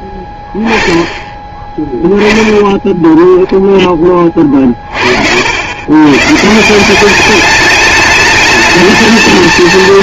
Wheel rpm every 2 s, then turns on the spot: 10, 0, 30, 150, 210.
none